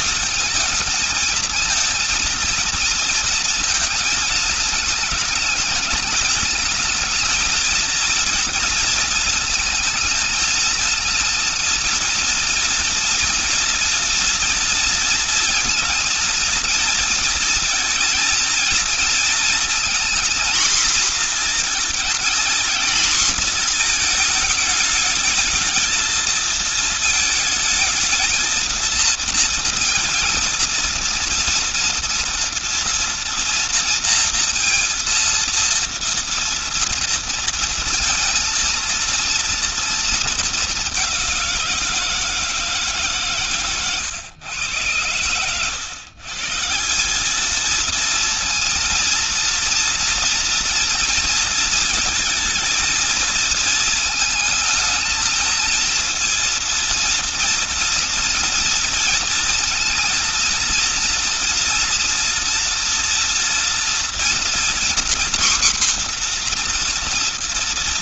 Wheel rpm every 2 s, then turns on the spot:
220, 220, 210, 220, 230, 220, 230, 230, 230, 230, 240, 230, 220, 220, 220, 230, 240, 230, 230, 230, 210, 150, 110, 160, 230, 230, 230, 220, 230, 230, 230, 230, 240, 240.
none